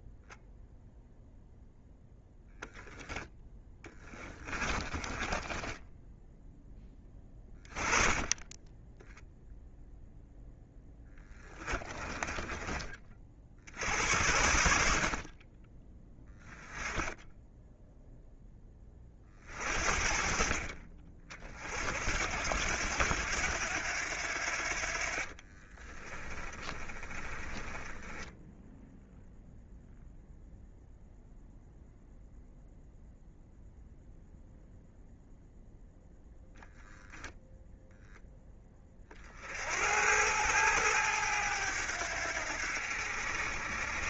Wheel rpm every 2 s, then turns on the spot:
0, 10, 20, 10, 10, 10, 30, 60, 10, 30, 40, 90, 50, 30, 0, 0, 0, 0, 0, 30, 100, 70.
4-6 10-12 26-28